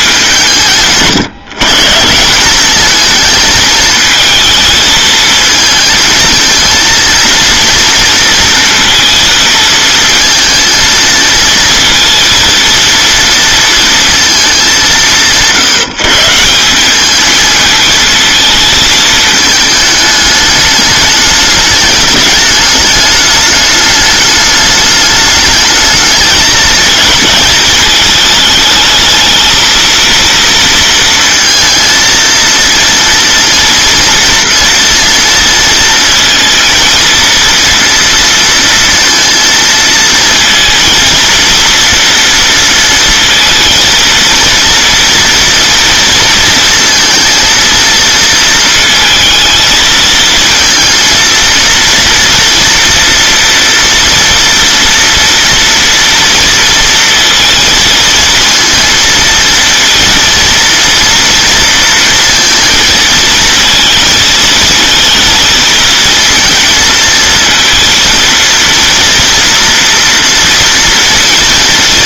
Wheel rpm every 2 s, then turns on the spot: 160, 210, 220, 230, 230, 230, 230, 190, 200, 220, 210, 210, 210, 220, 220, 230, 230, 230, 230, 230, 230, 230, 230, 230, 220, 230, 230, 240, 230, 230, 230, 230, 230, 230, 230, 230.
none